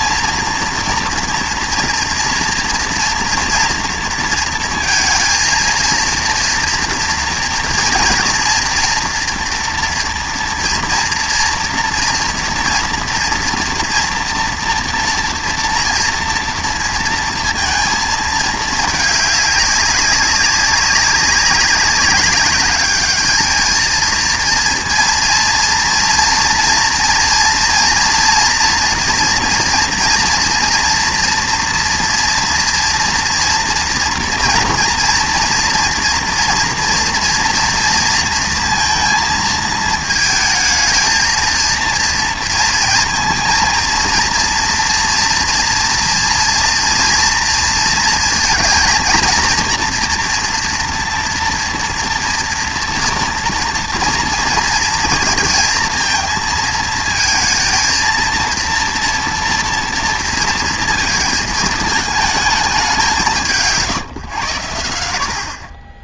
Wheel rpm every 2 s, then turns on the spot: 230, 240, 230, 230, 230, 230, 230, 240, 230, 210, 190, 210, 230, 230, 240, 230, 230, 230, 240, 230, 220, 230, 230, 230, 230, 240, 240, 230, 220, 230, 230, 200, 90.
none